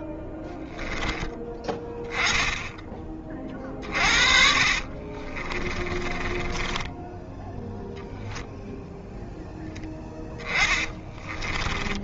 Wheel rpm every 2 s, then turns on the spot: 10, 10, 50, 20, 0, 20.
0-2 4-8 10-12